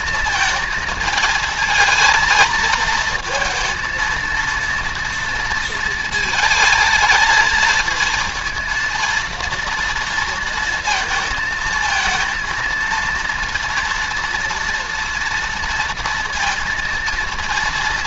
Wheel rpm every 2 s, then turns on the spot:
220, 220, 230, 220, 230, 230, 230, 230, 230.
none